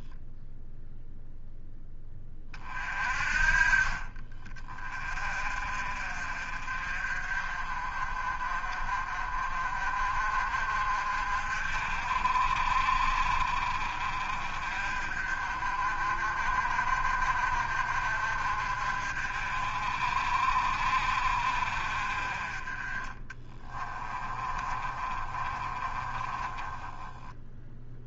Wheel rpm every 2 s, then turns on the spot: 0, 40, 30, 40, 40, 50, 50, 50, 50, 50, 50, 30, 30, 10.
24-28